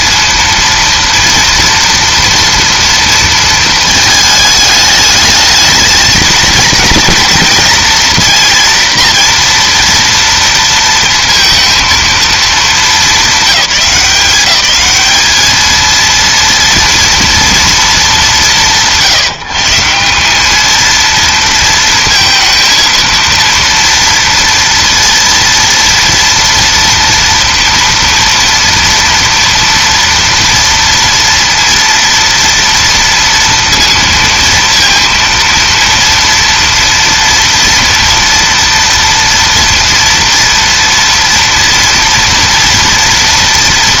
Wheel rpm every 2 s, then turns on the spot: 230, 230, 220, 220, 230, 230, 200, 200, 230, 170, 220, 230, 230, 230, 230, 230, 230, 230, 230, 230, 240, 230.
none